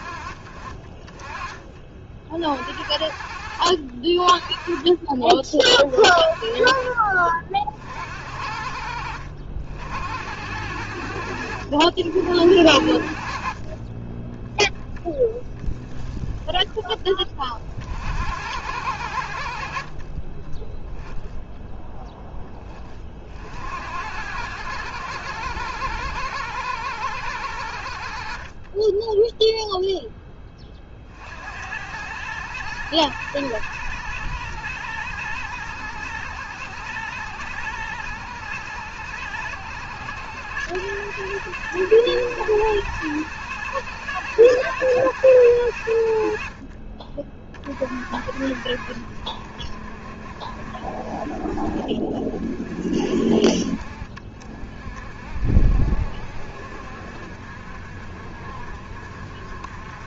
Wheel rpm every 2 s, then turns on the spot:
40, 50, 30, 40, 70, 80, 70, 30, 20, 80, 10, 20, 90, 110, 30, 30, 100, 100, 100, 100, 100, 100, 100, 50, 80, 50, 40, 40, 60, 60.
none